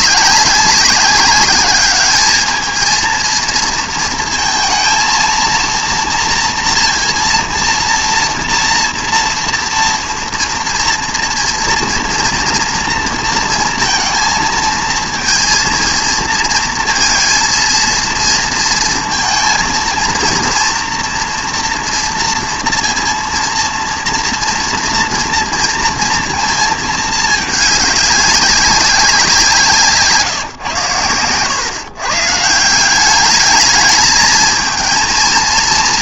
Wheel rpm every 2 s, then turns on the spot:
190, 220, 230, 240, 230, 230, 230, 230, 230, 230, 230, 230, 230, 220, 190, 120, 180, 230.
none